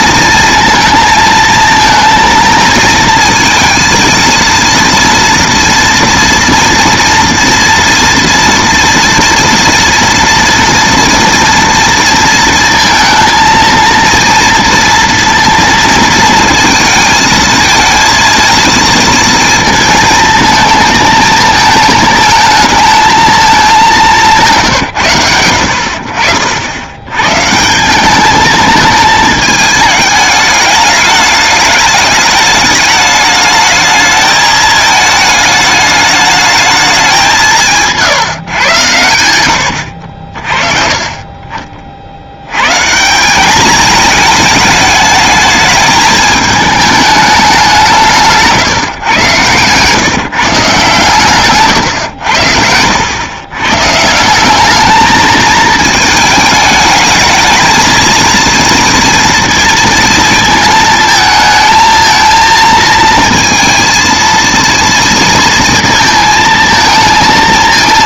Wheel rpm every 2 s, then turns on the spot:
230, 220, 230, 230, 230, 230, 230, 230, 230, 230, 220, 220, 160, 90, 210, 210, 210, 220, 210, 120, 40, 120, 220, 220, 160, 150, 80, 200, 210, 230, 220, 220, 230, 230.
48-50